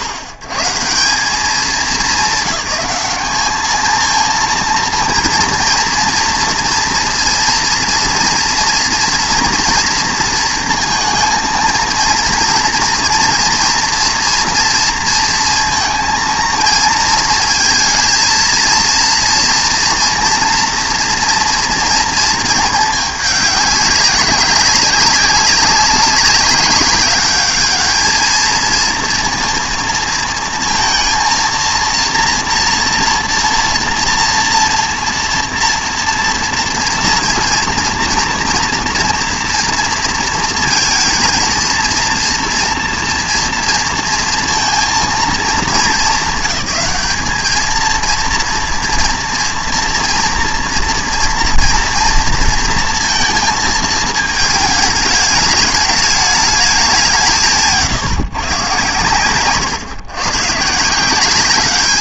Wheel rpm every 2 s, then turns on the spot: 110, 200, 230, 230, 240, 230, 230, 230, 230, 230, 240, 220, 190, 190, 220, 220, 230, 230, 230, 230, 230, 230, 230, 200, 230, 230, 230, 210, 210, 120, 140.
none